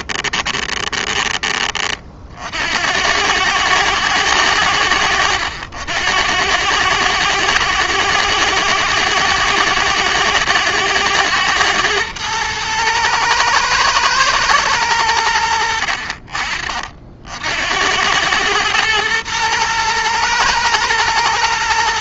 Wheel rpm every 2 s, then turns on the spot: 20, 90, 90, 110, 120, 110, 110, 100, 50, 110, 110.
none